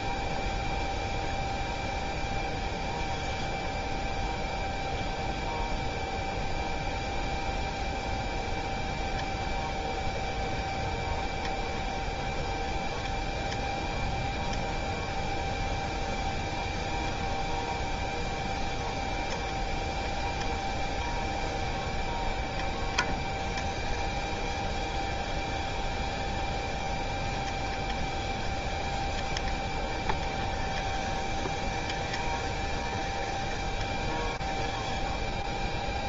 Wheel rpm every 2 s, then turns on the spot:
0, 0, 0, 0, 0, 0, 0, 0, 0, 0, 0, 0, 0, 0, 0, 0, 0, 0.
none